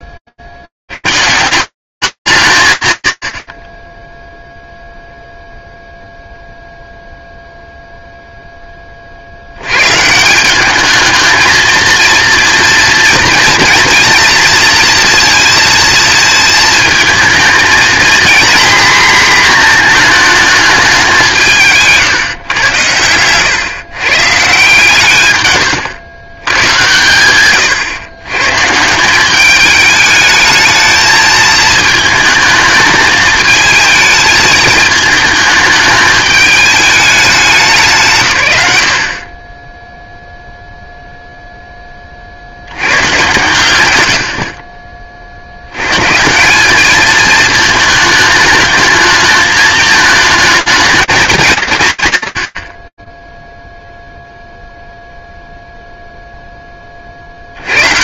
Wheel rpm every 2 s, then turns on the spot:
70, 130, 0, 0, 30, 210, 230, 230, 220, 240, 200, 110, 130, 110, 170, 220, 220, 220, 210, 50, 0, 120, 40, 220, 220, 210, 20, 0, 80.
none